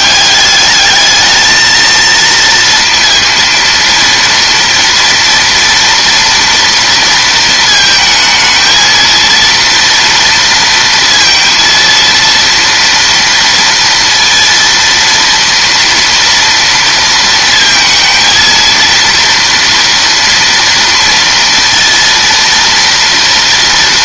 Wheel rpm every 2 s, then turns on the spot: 200, 230, 230, 230, 220, 230, 230, 230, 230, 230, 230, 230.
none